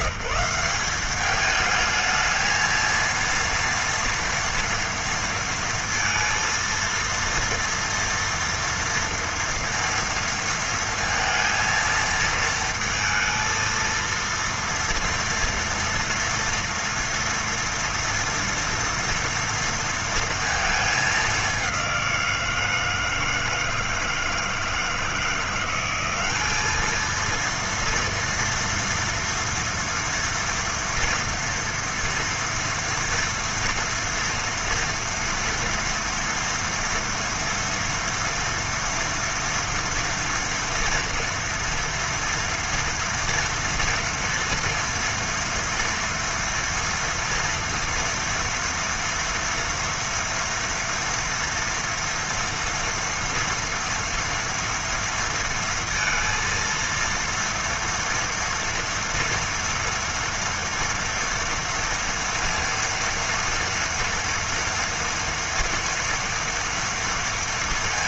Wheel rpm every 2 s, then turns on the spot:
170, 220, 230, 230, 230, 230, 230, 230, 230, 230, 230, 170, 160, 200, 230, 230, 230, 230, 230, 240, 230, 230, 230, 230, 230, 240, 230, 230, 230, 230, 230, 230, 240, 230.
none